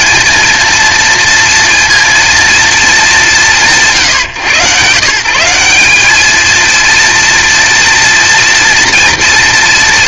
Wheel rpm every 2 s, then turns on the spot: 230, 220, 140, 220, 240.
none